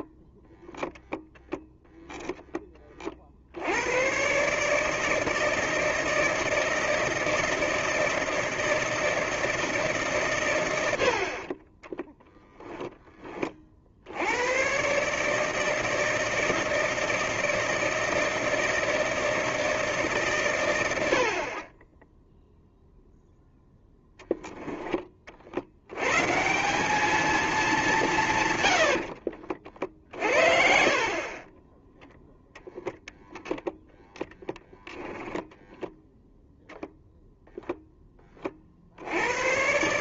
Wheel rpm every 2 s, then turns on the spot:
0, 10, 140, 160, 160, 100, 0, 100, 160, 160, 110, 0, 10, 180, 100, 50, 10, 10, 0, 30.
none